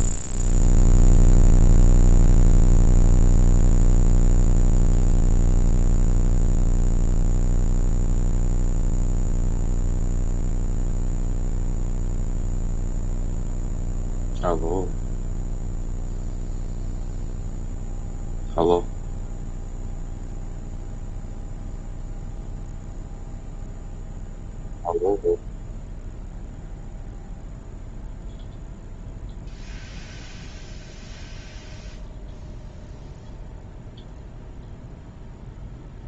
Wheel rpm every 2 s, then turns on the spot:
0, 0, 0, 0, 0, 0, 0, 0, 0, 0, 0, 0, 0, 0, 0, 0, 0, 0.
none